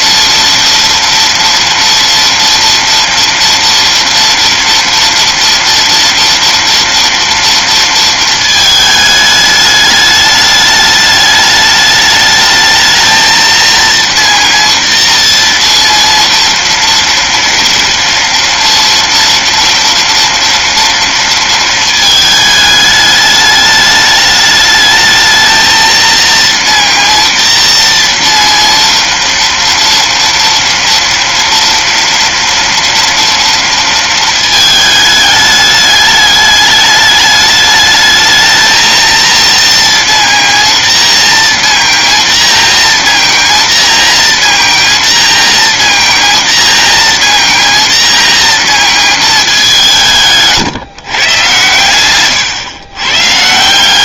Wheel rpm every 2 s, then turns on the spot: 230, 230, 230, 230, 220, 210, 220, 230, 240, 230, 230, 210, 210, 230, 230, 230, 230, 220, 210, 220, 230, 230, 230, 230, 230, 150, 120.
none